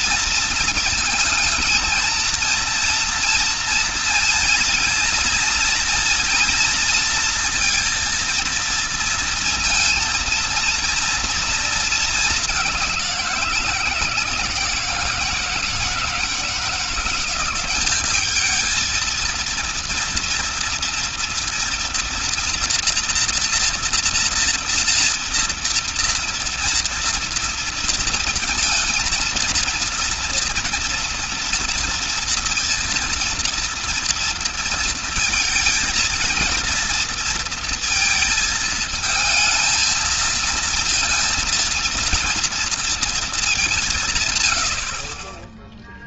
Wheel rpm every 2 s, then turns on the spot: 230, 230, 230, 230, 230, 230, 190, 170, 170, 230, 230, 230, 230, 230, 220, 230, 230, 230, 230, 220, 230, 230, 60.
none